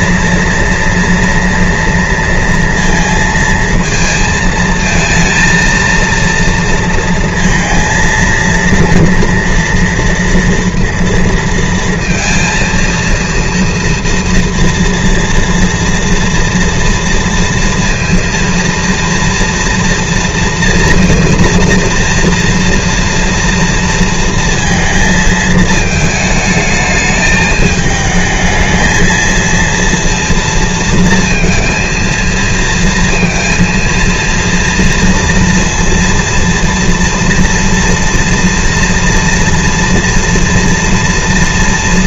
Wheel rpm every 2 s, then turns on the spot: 230, 230, 220, 230, 230, 230, 230, 230, 230, 230, 230, 230, 230, 220, 220, 230, 230, 230, 230, 230, 230.
none